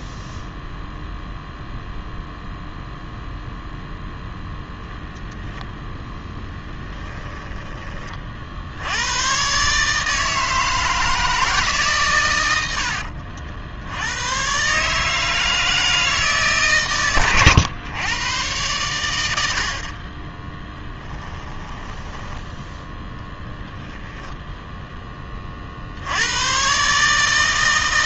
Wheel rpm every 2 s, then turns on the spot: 0, 0, 0, 10, 60, 160, 100, 130, 150, 110, 20, 10, 0, 120.
6-8 20-22